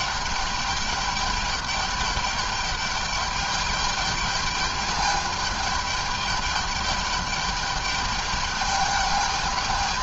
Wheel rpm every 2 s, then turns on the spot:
210, 210, 210, 210, 210.
none